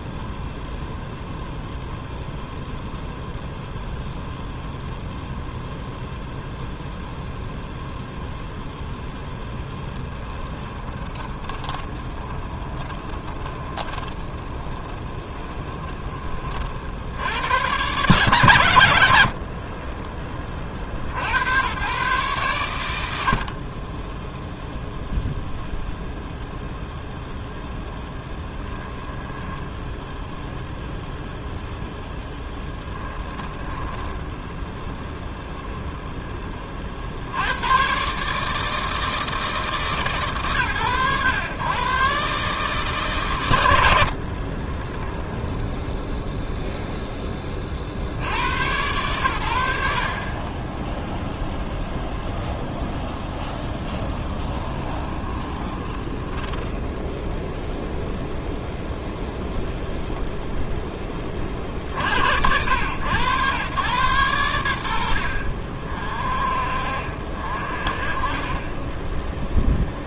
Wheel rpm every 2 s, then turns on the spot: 0, 0, 0, 0, 0, 20, 20, 20, 70, 110, 50, 110, 0, 0, 10, 0, 10, 0, 50, 160, 120, 150, 20, 0, 120, 30, 0, 20, 10, 0, 0, 100, 60, 50, 10.
10-16 28-30 32-34 44-46 54-58